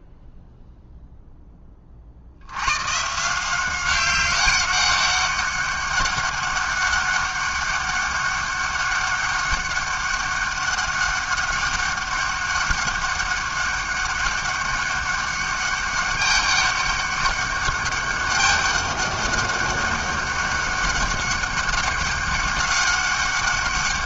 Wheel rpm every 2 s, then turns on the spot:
0, 160, 200, 200, 200, 200, 200, 200, 200, 200, 200, 200.
none